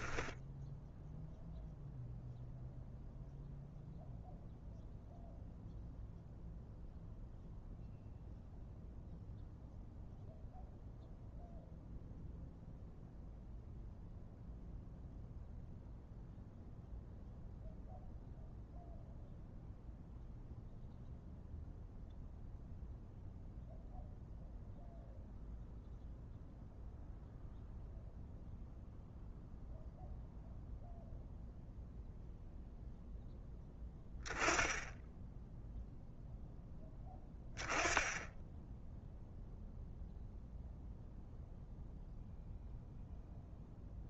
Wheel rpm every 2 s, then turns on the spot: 0, 0, 0, 0, 0, 0, 0, 0, 0, 0, 0, 0, 0, 0, 0, 0, 0, 0, 10, 0, 0, 0.
none